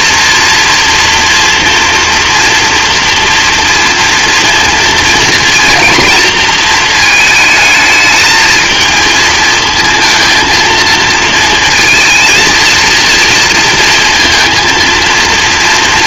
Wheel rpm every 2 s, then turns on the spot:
230, 240, 230, 230, 220, 230, 230, 230.
none